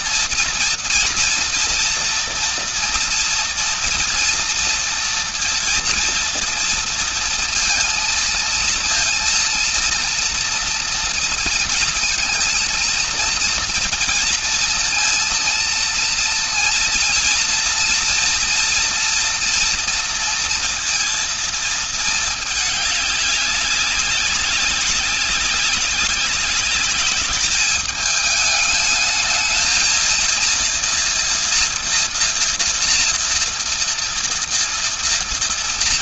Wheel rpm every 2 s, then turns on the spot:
230, 230, 230, 230, 230, 230, 230, 230, 230, 230, 230, 210, 200, 200, 220, 230, 230, 230.
none